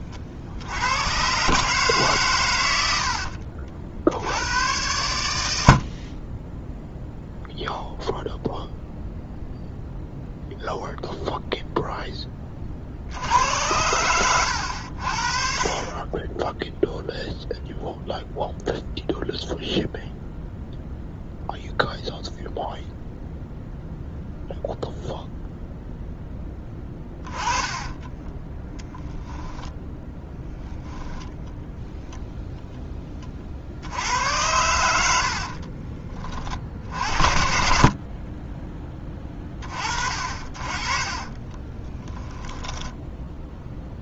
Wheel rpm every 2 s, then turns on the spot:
80, 90, 90, 0, 0, 0, 40, 70, 0, 0, 0, 0, 0, 10, 10, 10, 10, 90, 50, 20, 30, 10.
26-32 42-44